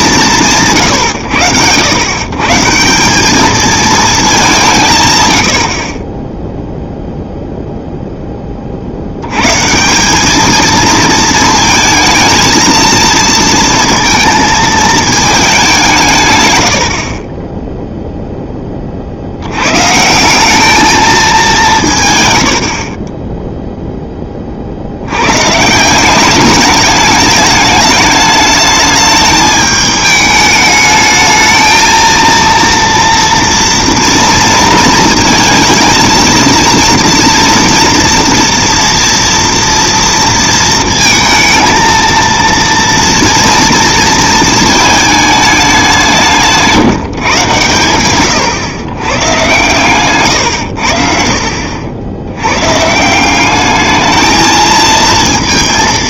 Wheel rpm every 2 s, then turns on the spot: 130, 190, 0, 20, 210, 220, 220, 120, 0, 160, 130, 10, 190, 210, 210, 230, 230, 220, 230, 230, 230, 230, 190, 110, 120, 80, 220, 230.
none